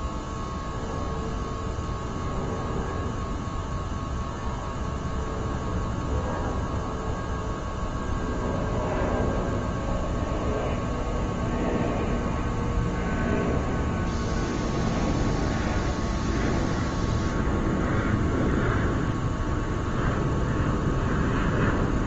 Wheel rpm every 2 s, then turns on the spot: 0, 0, 0, 0, 0, 0, 0, 0, 0, 0, 0.
none